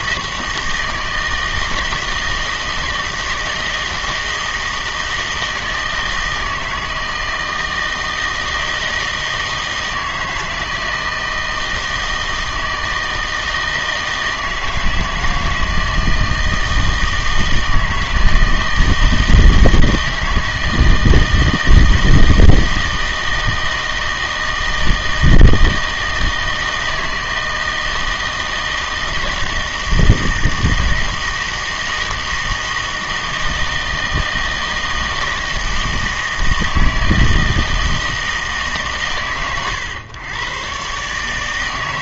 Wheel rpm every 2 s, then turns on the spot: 160, 160, 160, 160, 160, 160, 160, 160, 160, 160, 160, 160, 160, 160, 160, 160, 160, 160, 160, 130, 120.
none